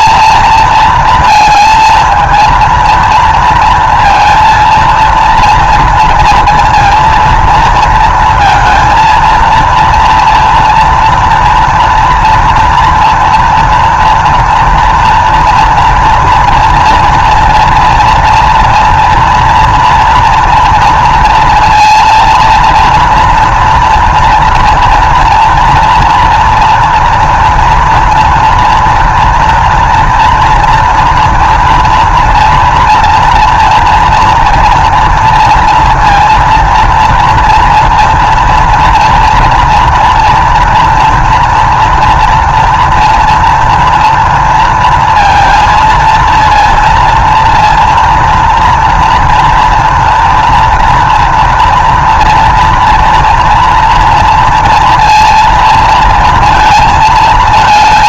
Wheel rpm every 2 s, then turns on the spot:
220, 230, 230, 230, 230, 240, 230, 230, 240, 230, 230, 230, 230, 240, 230, 230, 240, 230, 230, 230, 230, 230, 230, 230, 230, 230, 230, 230, 220.
none